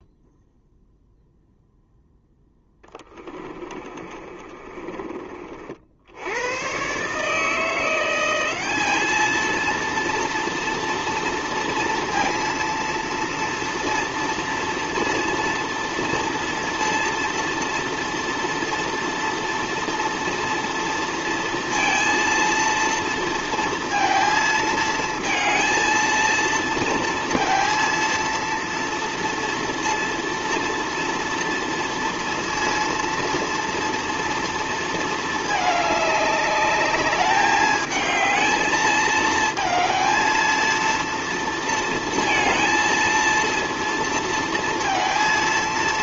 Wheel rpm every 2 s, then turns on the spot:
0, 10, 30, 120, 210, 230, 230, 230, 230, 230, 230, 230, 220, 230, 230, 230, 230, 230, 210, 220, 230, 230, 230.
2-6